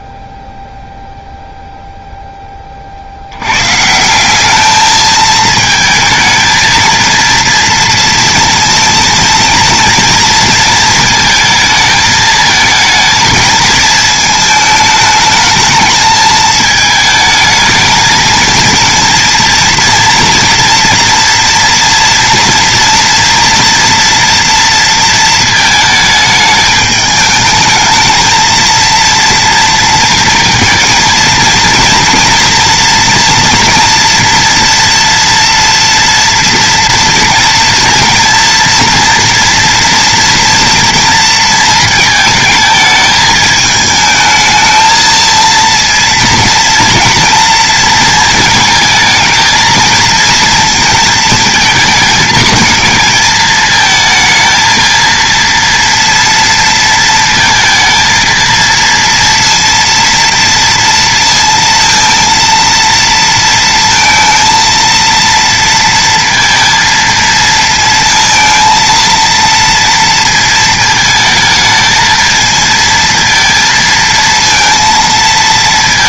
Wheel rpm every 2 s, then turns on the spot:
0, 70, 220, 230, 230, 230, 220, 220, 220, 230, 230, 230, 230, 210, 230, 230, 240, 230, 230, 230, 230, 220, 230, 230, 220, 230, 220, 230, 230, 230, 230, 230, 230, 230, 230, 220, 230, 230.
none